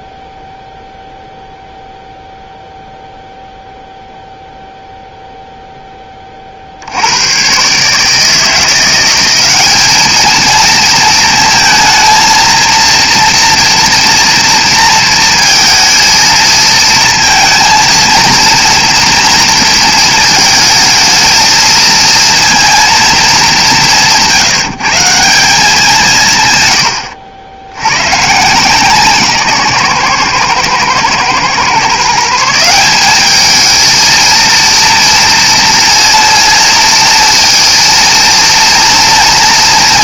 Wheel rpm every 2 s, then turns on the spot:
0, 0, 0, 40, 160, 220, 230, 230, 230, 230, 220, 230, 170, 120, 150, 120, 170, 230, 230, 230.
26-28